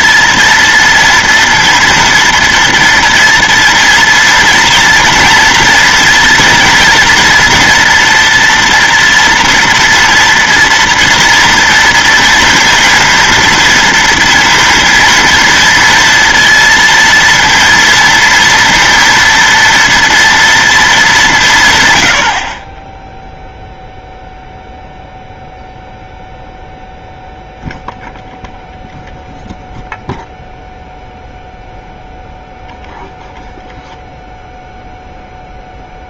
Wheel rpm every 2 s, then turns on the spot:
230, 230, 230, 230, 230, 230, 230, 230, 230, 230, 230, 90, 0, 0, 0, 0, 0, 0.
none